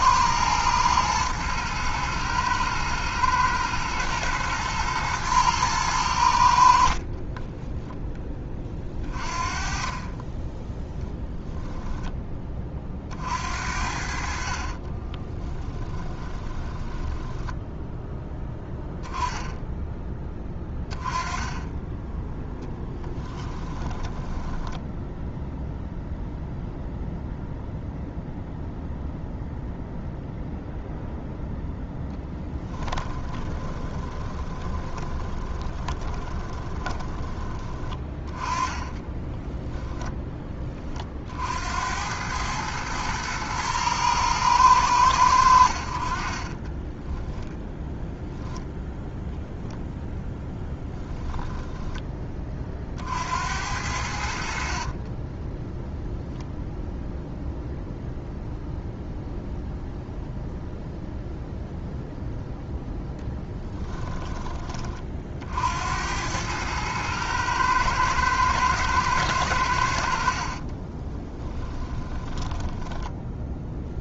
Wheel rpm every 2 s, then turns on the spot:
110, 110, 110, 50, 30, 10, 30, 40, 10, 10, 10, 10, 10, 0, 0, 0, 10, 20, 10, 20, 30, 110, 100, 10, 0, 10, 40, 40, 0, 0, 0, 0, 30, 110, 110, 30, 10.
14-18 22-24 32-40 46-48 50-52 54-56 70-74